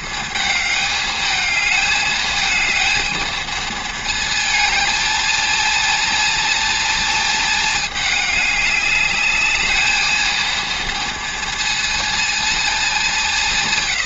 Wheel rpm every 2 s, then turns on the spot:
220, 220, 220, 230, 210, 230, 220.
none